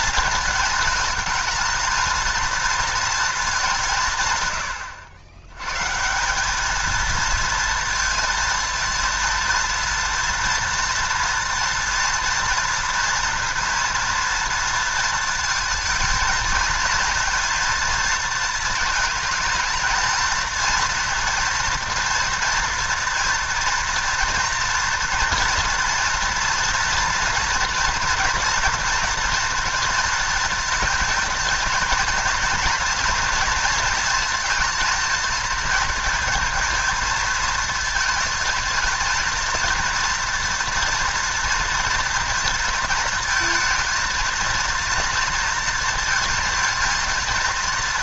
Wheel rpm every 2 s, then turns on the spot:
230, 230, 100, 220, 230, 230, 230, 230, 230, 220, 230, 240, 240, 230, 240, 220, 230, 220, 230, 230, 230, 230, 230, 220.
none